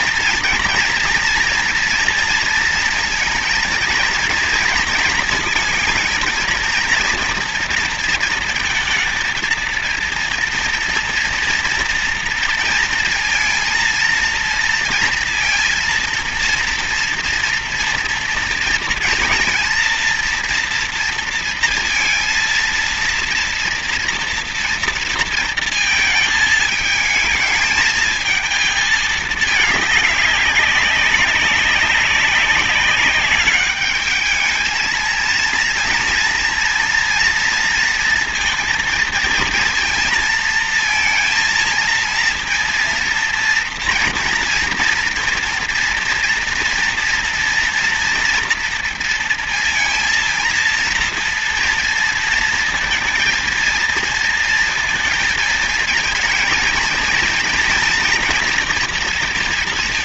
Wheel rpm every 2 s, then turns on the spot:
230, 230, 230, 230, 230, 230, 230, 230, 230, 230, 230, 230, 240, 220, 220, 200, 200, 220, 230, 230, 230, 230, 230, 230, 230, 230, 230, 230, 230, 240.
none